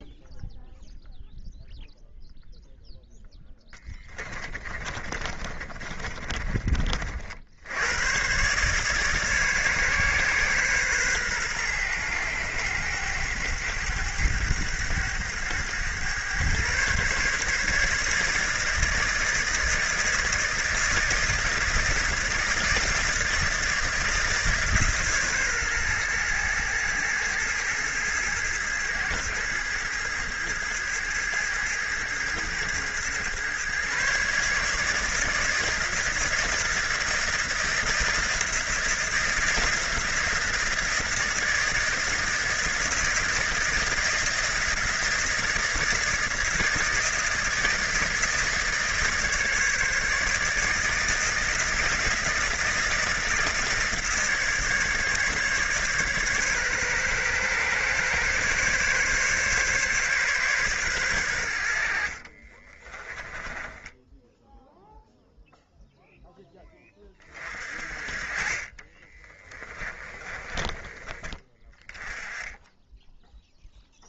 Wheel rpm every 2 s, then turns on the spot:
0, 10, 30, 60, 140, 120, 100, 100, 140, 160, 160, 160, 130, 110, 110, 110, 120, 160, 170, 170, 170, 160, 170, 170, 150, 160, 170, 150, 130, 140, 100, 20, 0, 30, 30, 20, 10.
4-6 62-64 68-70